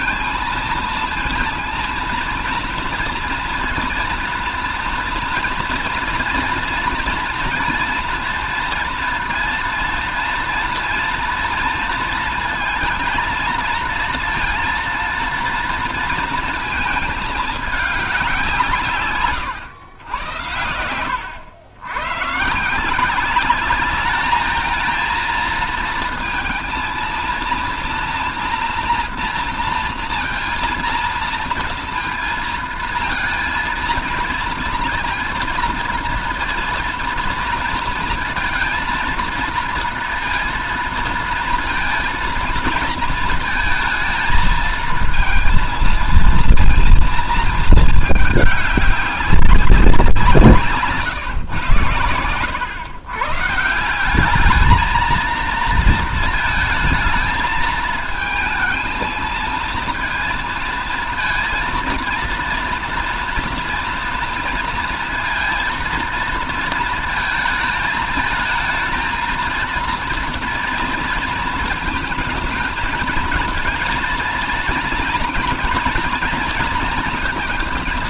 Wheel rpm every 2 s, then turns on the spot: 230, 230, 230, 230, 230, 230, 220, 230, 220, 160, 100, 160, 220, 230, 230, 230, 230, 230, 230, 230, 230, 230, 230, 230, 210, 150, 100, 220, 220, 220, 230, 230, 230, 220, 220, 230, 220, 230, 230.
none